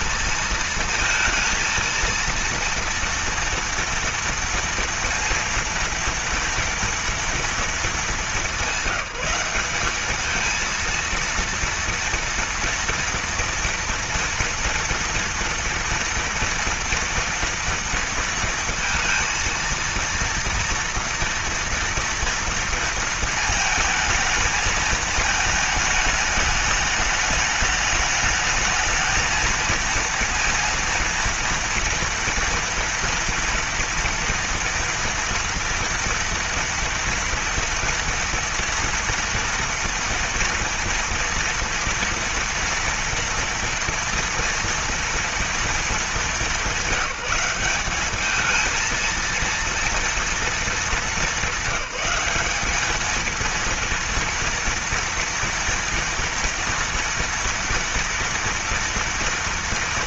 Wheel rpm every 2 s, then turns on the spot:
230, 230, 230, 230, 190, 230, 230, 230, 230, 230, 230, 230, 220, 210, 220, 230, 230, 230, 240, 230, 230, 230, 240, 190, 220, 210, 210, 230, 230, 230.
none